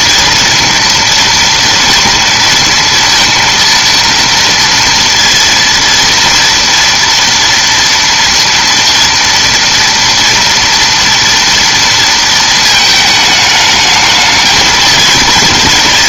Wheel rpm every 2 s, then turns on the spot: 230, 230, 230, 230, 230, 240, 220, 230.
none